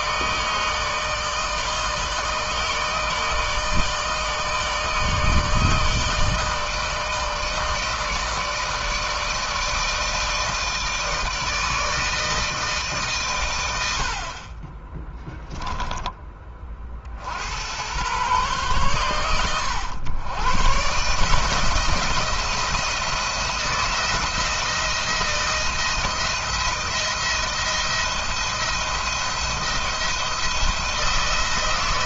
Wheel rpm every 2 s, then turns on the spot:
160, 160, 160, 160, 160, 160, 150, 30, 30, 120, 120, 170, 170, 170, 160, 170.
none